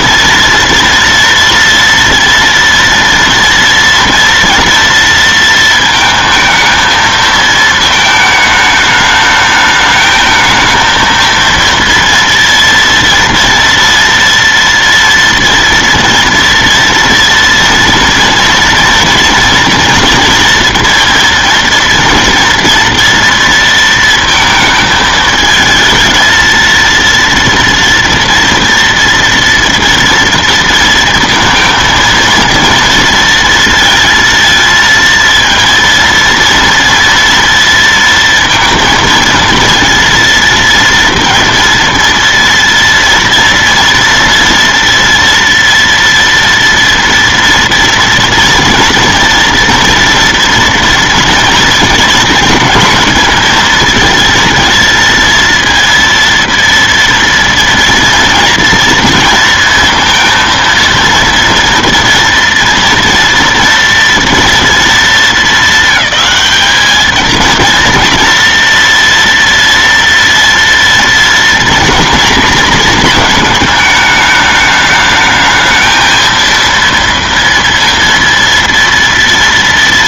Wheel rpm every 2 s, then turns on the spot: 230, 230, 230, 220, 220, 220, 230, 230, 230, 230, 230, 230, 220, 230, 230, 230, 230, 230, 230, 230, 230, 230, 230, 230, 230, 230, 220, 220, 230, 230, 230, 230, 230, 200, 230, 230, 230, 210, 230, 230.
none